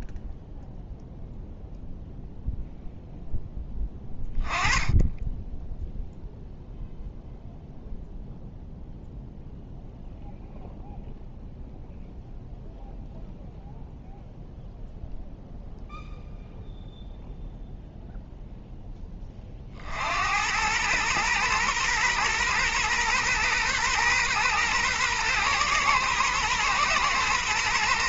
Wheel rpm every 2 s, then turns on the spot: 0, 0, 20, 0, 0, 0, 0, 0, 0, 0, 100, 120, 120, 130.
none